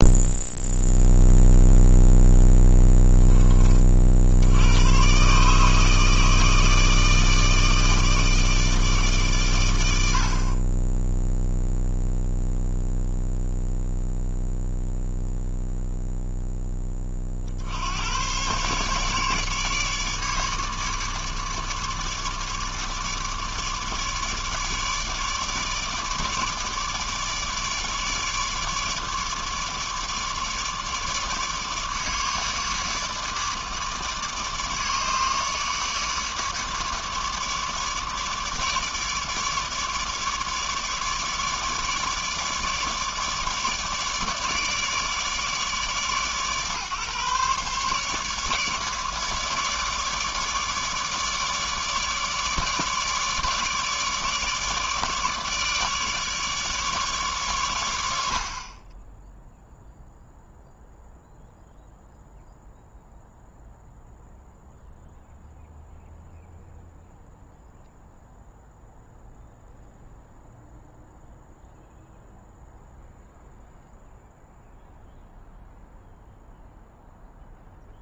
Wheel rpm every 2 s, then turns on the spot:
0, 10, 100, 160, 140, 20, 0, 0, 20, 140, 150, 150, 150, 150, 150, 150, 150, 150, 150, 150, 150, 150, 150, 140, 150, 150, 150, 150, 150, 20, 0, 0, 0, 0, 0, 0, 0, 0, 0.
none